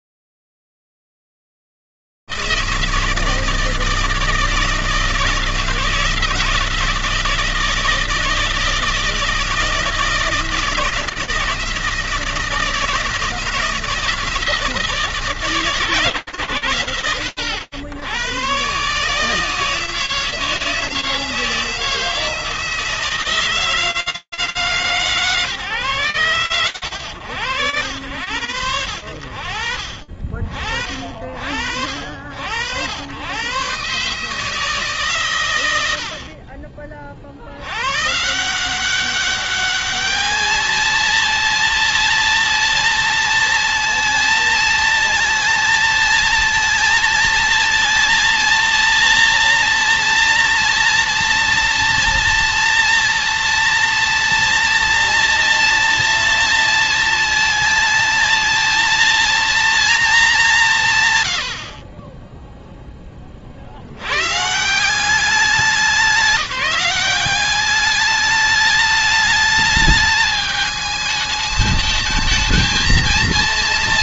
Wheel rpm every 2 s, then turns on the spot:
60, 160, 160, 170, 160, 160, 170, 160, 140, 110, 160, 160, 160, 110, 60, 60, 120, 100, 90, 210, 230, 230, 220, 230, 230, 230, 240, 230, 230, 230, 60, 70, 190, 200, 210, 220, 230.
none